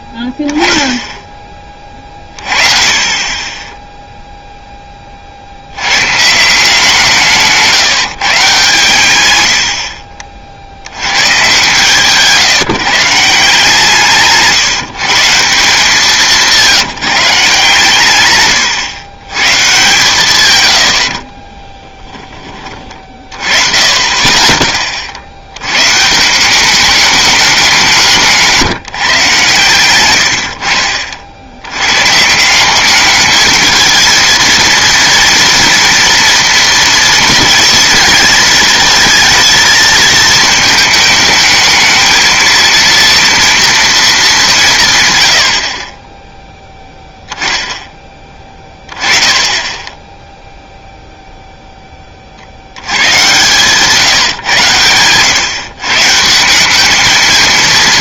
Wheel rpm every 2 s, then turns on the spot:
10, 30, 10, 170, 130, 70, 150, 150, 170, 100, 100, 30, 30, 190, 160, 60, 190, 230, 230, 220, 220, 220, 170, 0, 20, 0, 80, 110, 190.
none